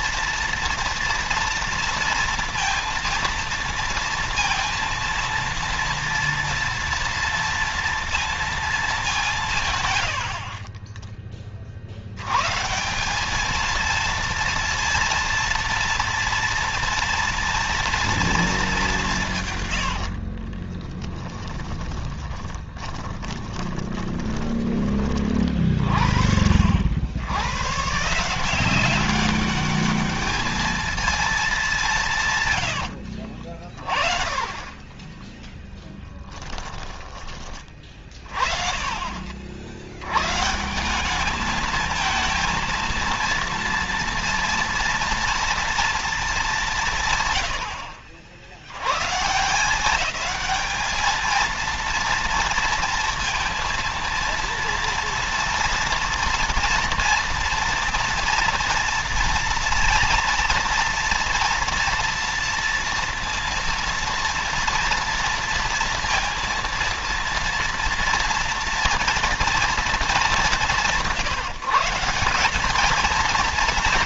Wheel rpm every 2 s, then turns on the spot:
230, 230, 230, 230, 230, 50, 130, 230, 230, 220, 40, 20, 20, 50, 160, 210, 130, 40, 10, 40, 100, 220, 230, 220, 60, 190, 230, 230, 230, 230, 230, 230, 230, 230, 230, 170, 170.
20-26 32-38